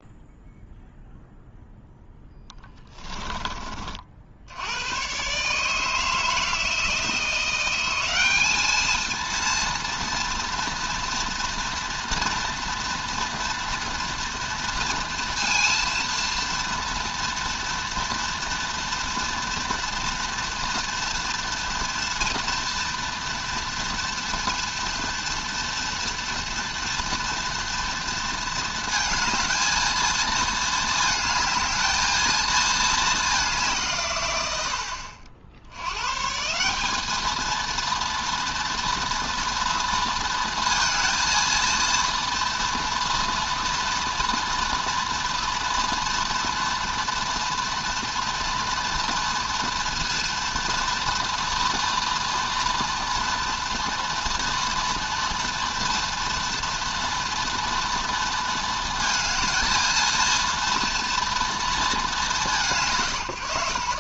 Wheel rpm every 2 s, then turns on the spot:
0, 20, 110, 160, 220, 240, 230, 230, 230, 230, 230, 230, 230, 230, 220, 230, 220, 90, 200, 240, 230, 230, 230, 230, 230, 230, 230, 230, 230, 230, 230, 140.
2-4